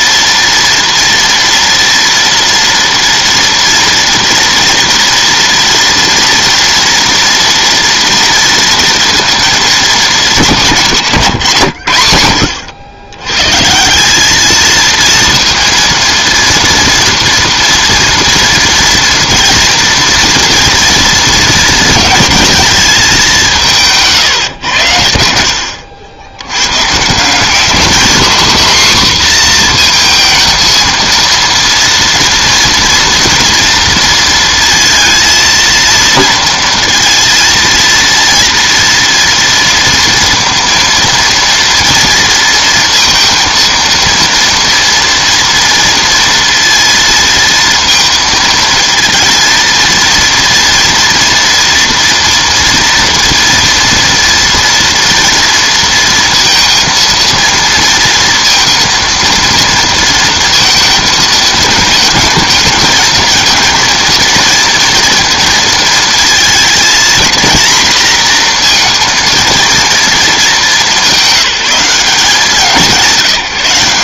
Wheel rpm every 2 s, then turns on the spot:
230, 230, 230, 230, 230, 170, 90, 220, 230, 230, 230, 220, 110, 110, 250, 230, 230, 230, 230, 230, 230, 230, 230, 230, 230, 230, 230, 230, 230, 230, 230, 220, 230, 220, 230, 200, 180.
none